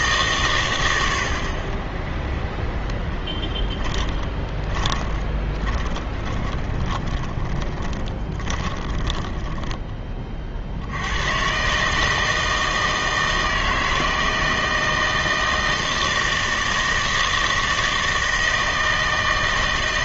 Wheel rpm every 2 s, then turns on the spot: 110, 0, 20, 20, 20, 70, 160, 160, 160, 160.
4-10